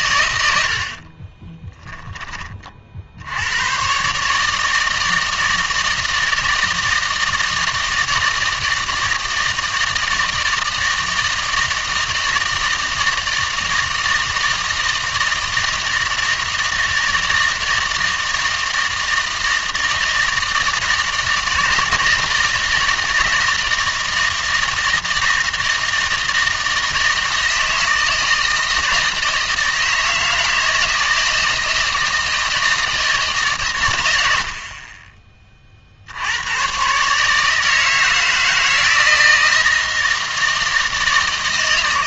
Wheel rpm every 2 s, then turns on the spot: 80, 40, 160, 160, 160, 160, 160, 160, 160, 160, 160, 160, 160, 160, 160, 160, 170, 50, 130, 160, 160.
none